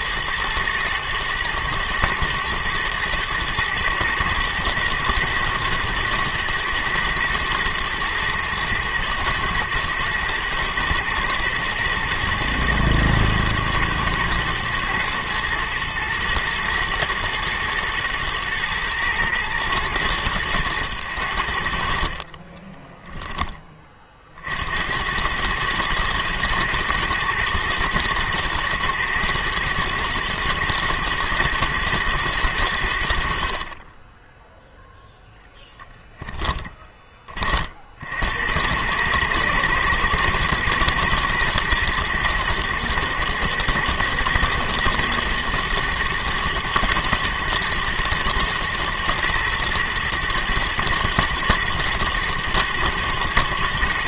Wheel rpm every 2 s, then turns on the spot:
110, 110, 120, 120, 120, 120, 110, 110, 110, 110, 110, 20, 60, 120, 120, 120, 100, 10, 10, 80, 120, 110, 120, 120, 110, 120, 120.
22-24 36-38